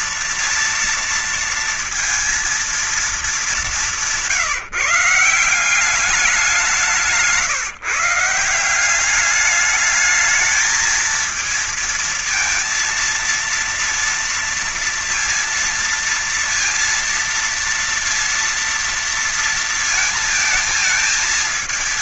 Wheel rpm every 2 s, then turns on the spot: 230, 230, 160, 180, 160, 220, 230, 230, 230, 230, 220.
none